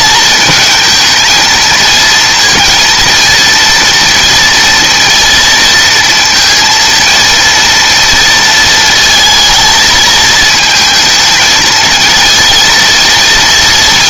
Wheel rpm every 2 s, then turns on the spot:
220, 230, 230, 230, 230, 220, 220.
none